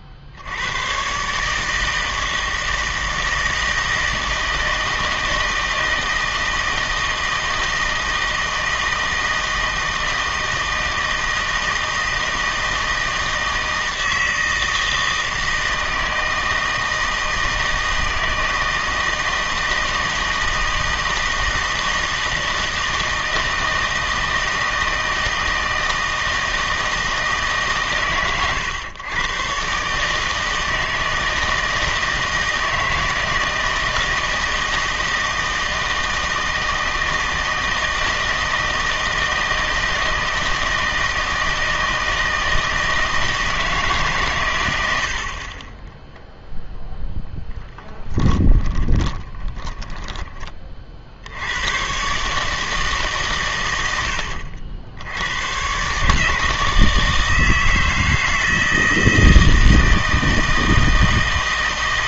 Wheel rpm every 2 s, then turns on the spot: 100, 160, 160, 160, 160, 160, 160, 160, 160, 160, 160, 160, 160, 160, 120, 160, 160, 160, 160, 160, 160, 160, 100, 0, 20, 40, 150, 70, 160, 160, 160.
48-50